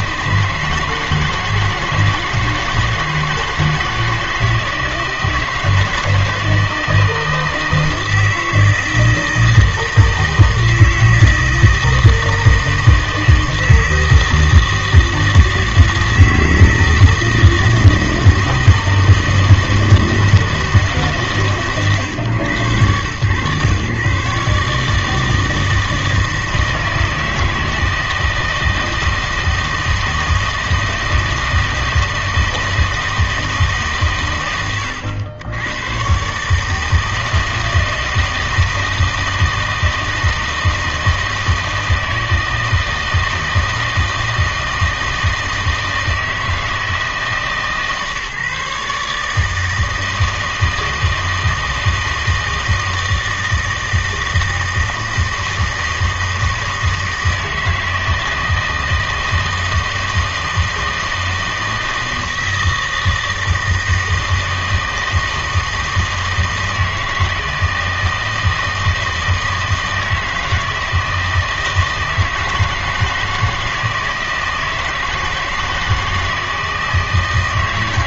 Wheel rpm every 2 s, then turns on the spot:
150, 160, 160, 160, 160, 160, 160, 160, 160, 160, 150, 110, 150, 160, 160, 160, 160, 100, 150, 160, 160, 160, 160, 160, 140, 160, 160, 160, 160, 160, 160, 160, 160, 160, 160, 160, 160, 160, 160.
none